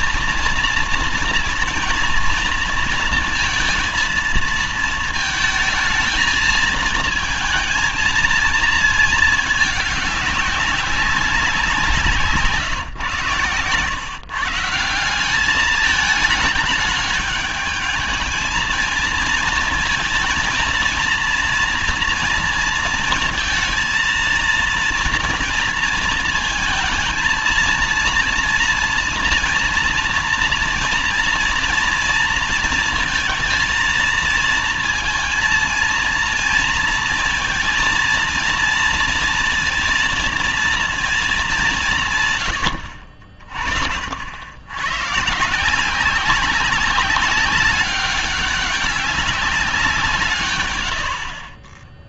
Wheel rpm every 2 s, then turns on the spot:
230, 230, 230, 220, 220, 200, 150, 160, 220, 220, 220, 230, 230, 220, 230, 230, 230, 230, 230, 230, 230, 120, 90, 200, 200, 130.
none